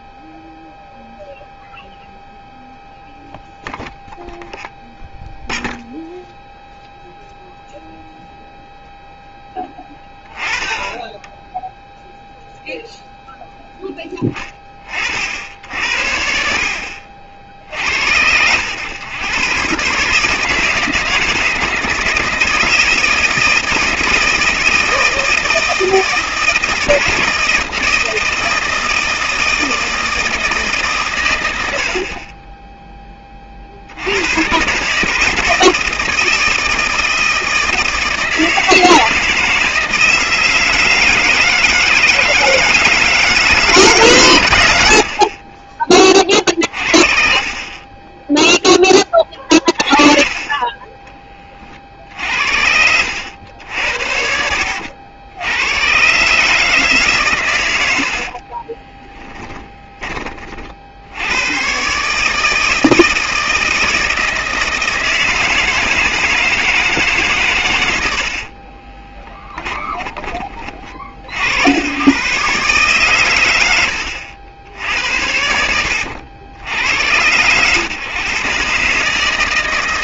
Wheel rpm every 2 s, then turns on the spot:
0, 0, 0, 0, 0, 20, 0, 50, 70, 100, 160, 160, 160, 160, 160, 150, 10, 150, 160, 160, 160, 160, 90, 40, 10, 20, 80, 80, 150, 20, 60, 160, 160, 160, 30, 40, 140, 80, 100, 140.
58-60 68-70